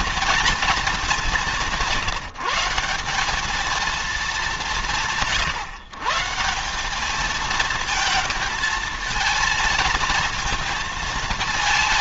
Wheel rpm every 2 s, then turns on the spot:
200, 160, 170, 190, 230, 230.
none